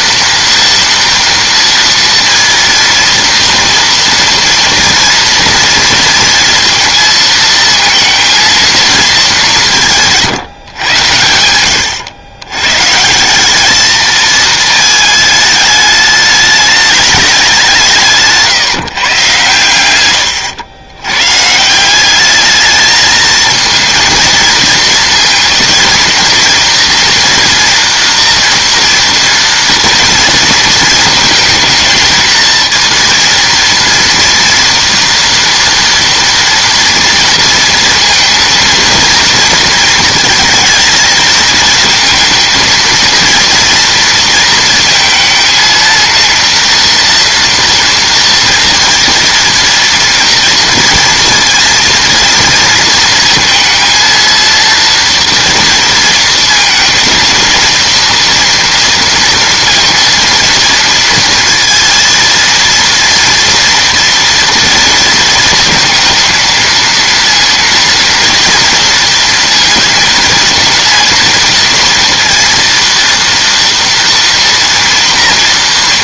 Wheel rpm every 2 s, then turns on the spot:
230, 230, 230, 230, 230, 130, 120, 220, 210, 170, 110, 210, 230, 240, 230, 230, 230, 230, 230, 230, 220, 230, 230, 230, 230, 240, 230, 230, 230, 240, 230, 230, 230, 230, 230, 230, 230, 230.
none